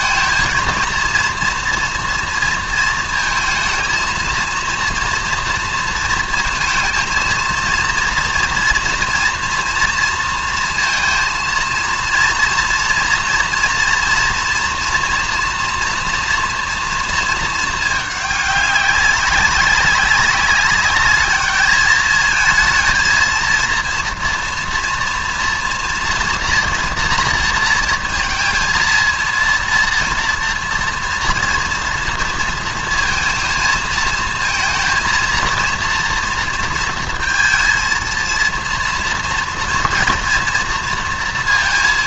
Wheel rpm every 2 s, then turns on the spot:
230, 230, 230, 230, 230, 230, 230, 230, 230, 200, 200, 220, 230, 230, 230, 240, 230, 230, 230, 230, 230.
none